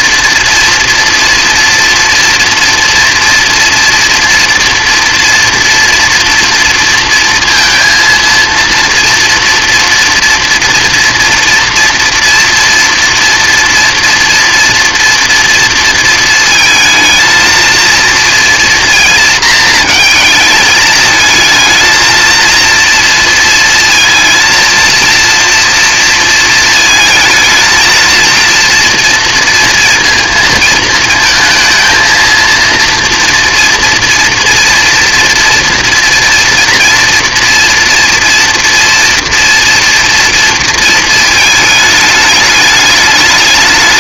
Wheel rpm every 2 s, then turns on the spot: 230, 240, 240, 230, 230, 230, 240, 240, 220, 230, 220, 230, 230, 220, 230, 220, 230, 230, 230, 240, 230, 210.
none